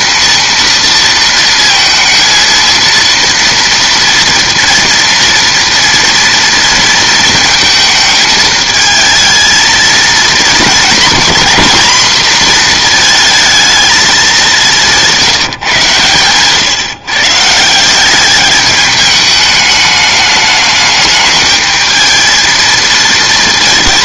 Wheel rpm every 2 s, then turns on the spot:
230, 230, 230, 230, 220, 220, 240, 200, 130, 210, 210, 220.
none